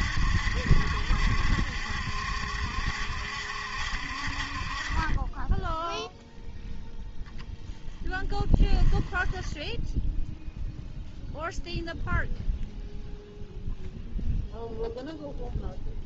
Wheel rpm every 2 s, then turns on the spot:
70, 70, 40, 0, 10, 0, 0, 0.
8-10